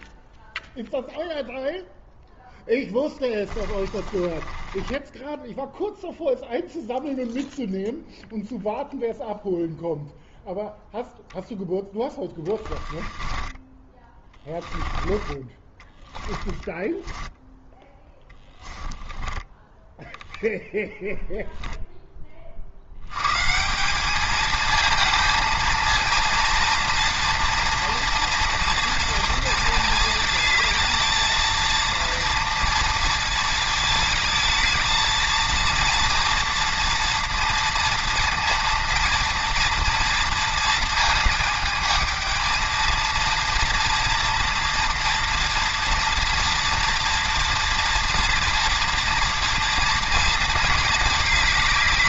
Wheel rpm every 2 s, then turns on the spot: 0, 10, 10, 0, 0, 0, 20, 20, 10, 10, 0, 90, 220, 230, 230, 220, 230, 220, 230, 230, 230, 230, 230, 230, 230, 220.
2-6 12-20